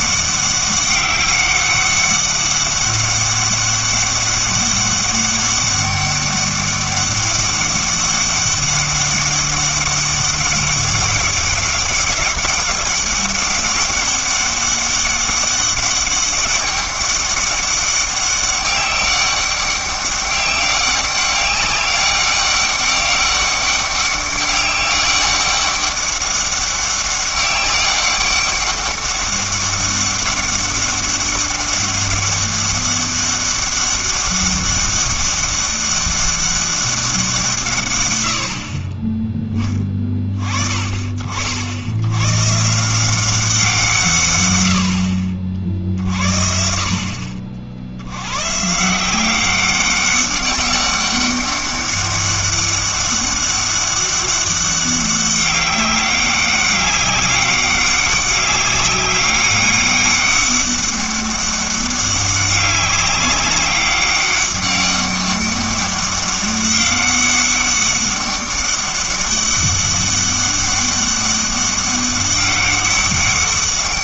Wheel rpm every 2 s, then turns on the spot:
200, 200, 200, 200, 200, 200, 200, 200, 200, 200, 200, 200, 200, 200, 200, 200, 200, 200, 200, 40, 40, 150, 100, 50, 140, 200, 200, 200, 200, 190, 200, 200, 200, 200, 200, 200, 200.
none